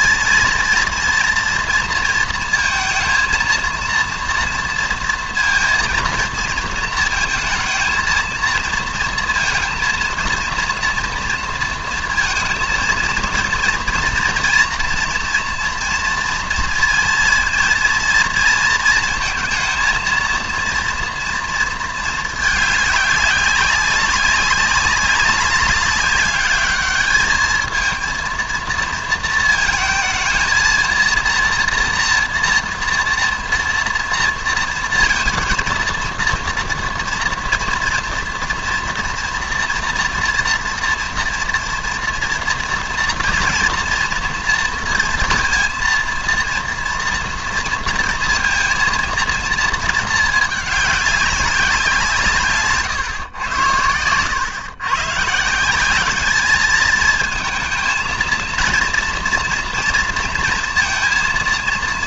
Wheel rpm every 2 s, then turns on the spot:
230, 230, 230, 220, 230, 230, 230, 230, 230, 230, 230, 210, 200, 200, 230, 230, 230, 230, 230, 230, 230, 230, 230, 230, 220, 210, 140, 120, 210, 230, 230.
none